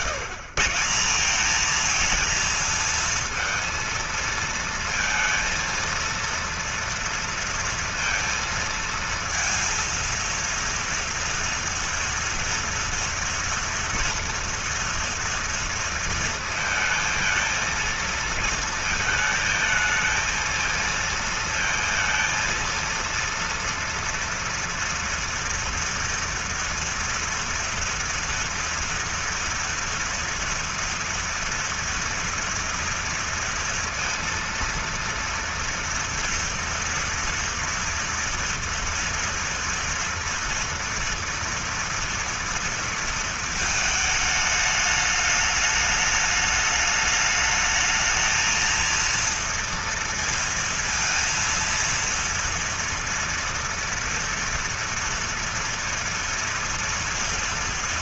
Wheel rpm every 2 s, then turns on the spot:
150, 230, 230, 230, 230, 230, 230, 230, 230, 220, 230, 230, 230, 230, 230, 230, 230, 230, 230, 230, 230, 230, 210, 210, 230, 230, 230, 230, 230.
none